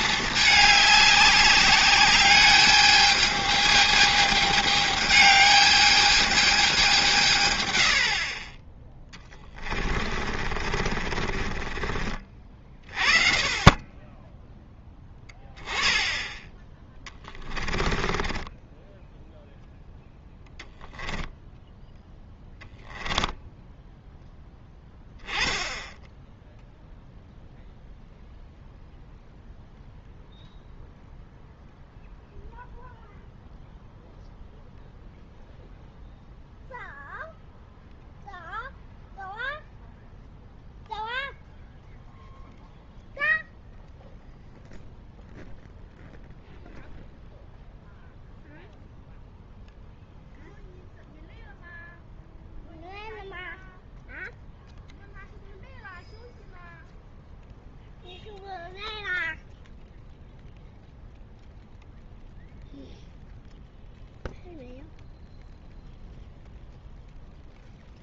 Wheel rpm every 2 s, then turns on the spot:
210, 210, 210, 210, 20, 40, 40, 10, 10, 10, 0, 10, 10, 0, 0, 0, 0, 0, 0, 0, 0, 0, 0, 0, 0, 0, 0, 0, 0, 0, 0, 0, 0, 0.
10-12 18-20 22-24